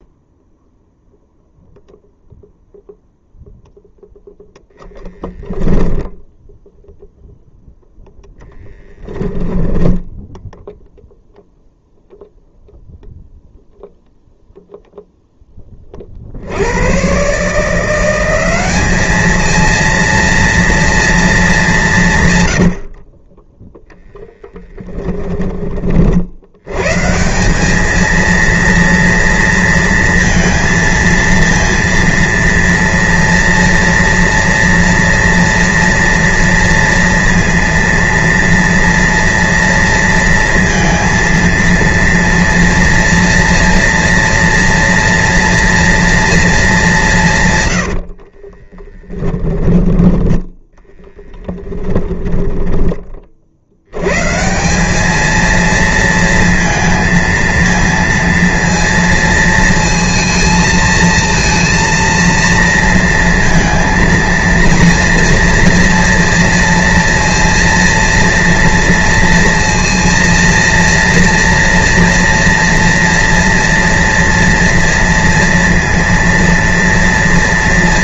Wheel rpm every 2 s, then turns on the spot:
0, 0, 10, 0, 0, 0, 0, 0, 110, 210, 230, 60, 10, 140, 230, 230, 230, 230, 230, 230, 230, 230, 230, 190, 20, 10, 30, 200, 220, 230, 230, 230, 230, 230, 230, 230, 230, 230, 230.
4-6 22-26 48-50